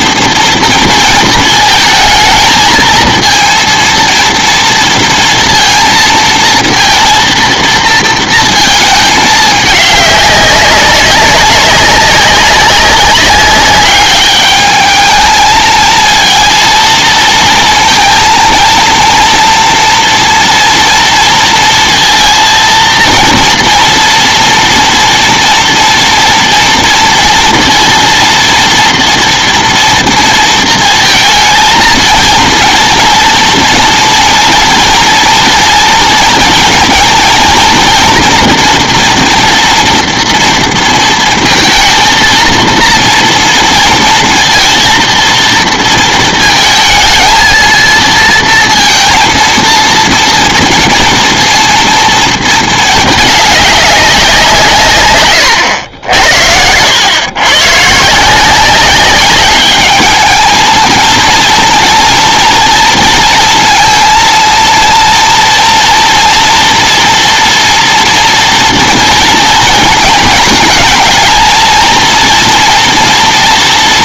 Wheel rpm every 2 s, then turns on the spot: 230, 220, 230, 230, 220, 200, 200, 210, 230, 230, 230, 230, 230, 230, 230, 230, 230, 230, 230, 230, 230, 230, 230, 220, 230, 230, 220, 150, 90, 190, 220, 230, 230, 240, 230, 210, 230.
none